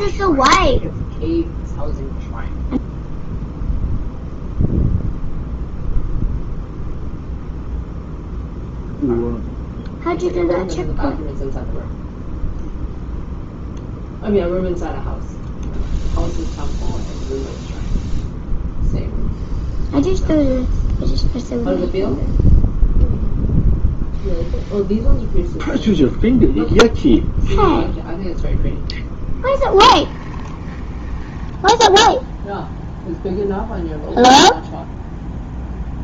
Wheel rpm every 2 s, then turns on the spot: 0, 0, 0, 0, 0, 0, 0, 0, 0, 0, 0, 0, 0, 0, 0, 20, 0, 0.
30-32